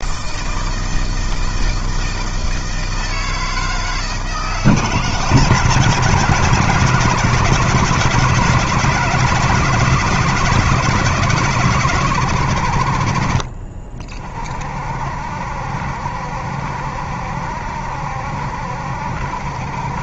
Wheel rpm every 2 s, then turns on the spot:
160, 160, 150, 160, 160, 170, 70, 50, 70, 70.
none